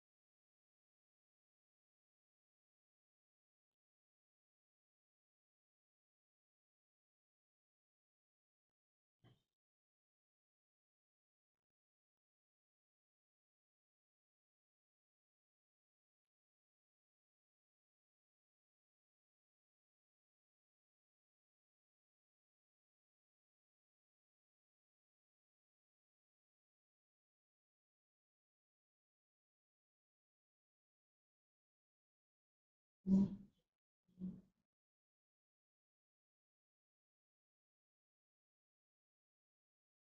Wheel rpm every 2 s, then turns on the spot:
0, 0, 0, 0, 0, 0, 0, 0, 0, 0, 0, 0, 0, 0, 0, 0, 0, 0, 0, 0.
none